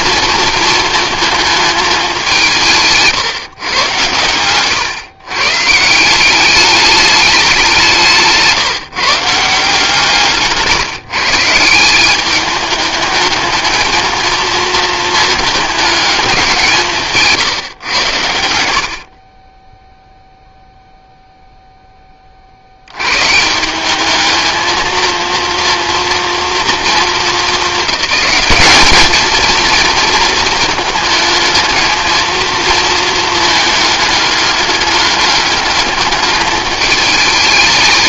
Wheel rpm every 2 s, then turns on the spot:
230, 170, 120, 200, 160, 150, 210, 230, 180, 70, 0, 80, 220, 230, 210, 220, 230, 210, 210.
none